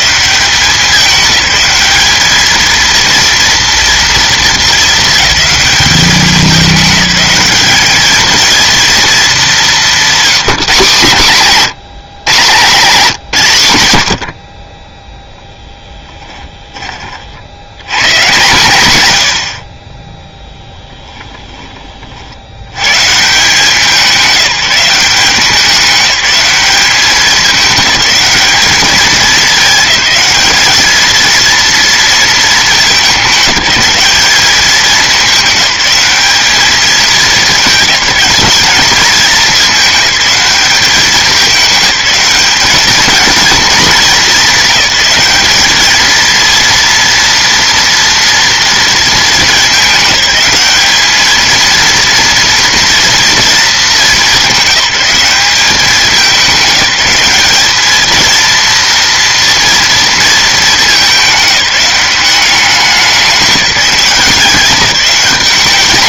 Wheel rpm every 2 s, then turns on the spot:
200, 220, 220, 200, 230, 180, 180, 40, 20, 120, 10, 110, 180, 200, 210, 210, 210, 210, 210, 200, 200, 200, 200, 230, 230, 200, 230, 190, 200, 230, 220, 190, 180.
20-22